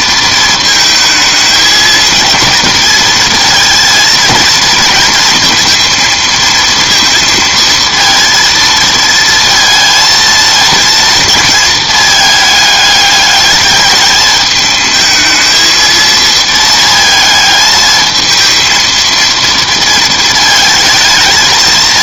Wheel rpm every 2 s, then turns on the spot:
230, 220, 230, 230, 230, 230, 210, 220, 220, 220, 220.
none